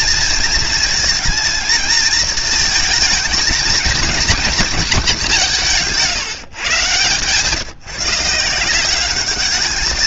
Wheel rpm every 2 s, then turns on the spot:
230, 220, 170, 130, 200.
none